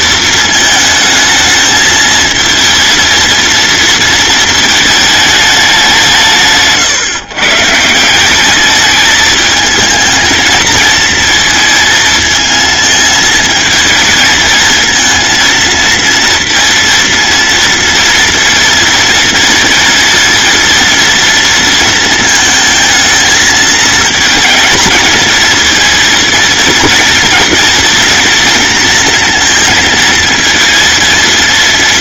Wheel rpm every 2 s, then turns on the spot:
220, 220, 220, 140, 210, 220, 220, 220, 230, 230, 230, 220, 230, 230, 230, 230.
none